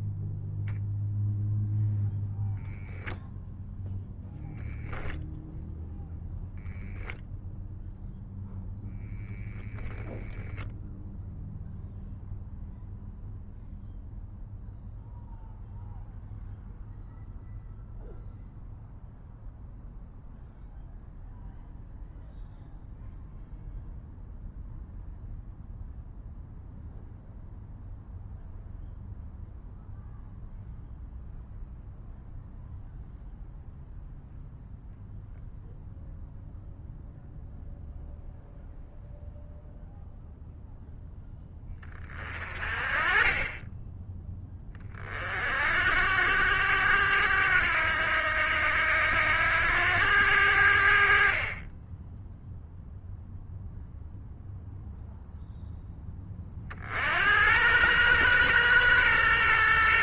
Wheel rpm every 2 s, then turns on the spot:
0, 0, 0, 0, 0, 0, 0, 0, 0, 0, 0, 0, 0, 0, 0, 0, 0, 0, 0, 0, 0, 40, 30, 100, 80, 80, 0, 0, 50, 120.
none